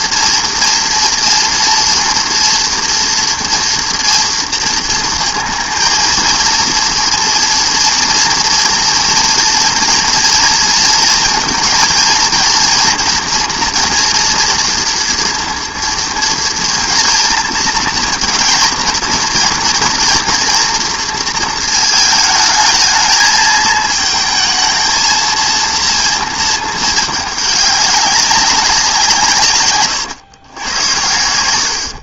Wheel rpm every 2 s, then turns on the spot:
240, 240, 230, 230, 230, 230, 230, 230, 230, 230, 230, 220, 220, 220, 190, 110.
none